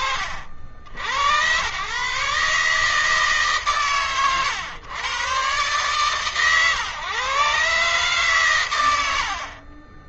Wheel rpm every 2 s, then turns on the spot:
80, 150, 110, 130, 130.
none